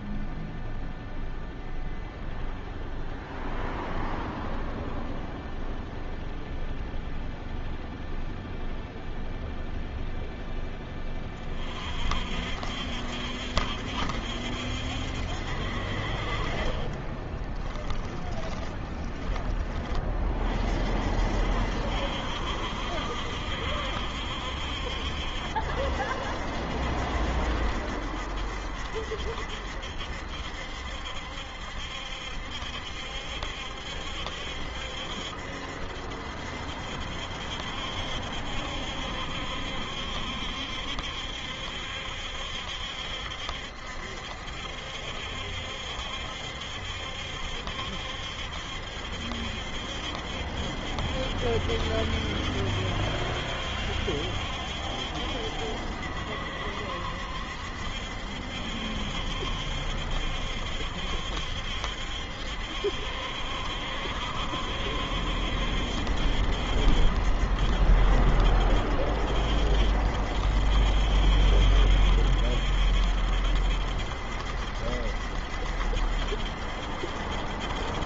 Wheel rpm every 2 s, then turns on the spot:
0, 0, 0, 0, 0, 0, 50, 70, 50, 10, 30, 70, 70, 70, 70, 70, 70, 70, 70, 70, 70, 70, 70, 70, 70, 70, 70, 70, 70, 70, 70, 70, 70, 70, 70, 70, 70, 70, 70.
16-20